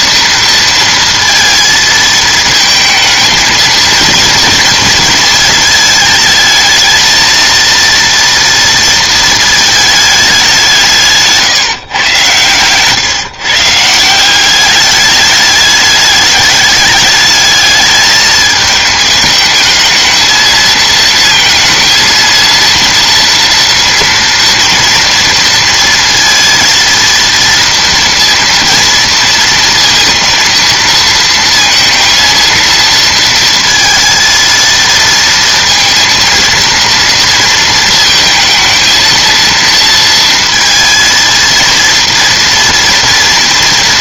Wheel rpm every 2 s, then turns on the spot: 230, 220, 230, 220, 230, 170, 130, 200, 210, 220, 220, 230, 230, 230, 230, 230, 230, 230, 230, 220, 230, 230.
12-14